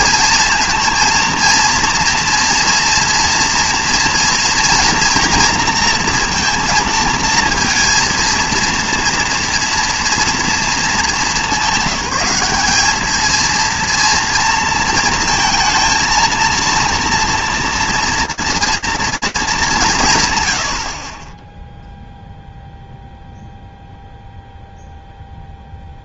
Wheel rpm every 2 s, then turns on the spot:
230, 240, 240, 230, 230, 230, 200, 230, 230, 230, 100, 0, 0.
none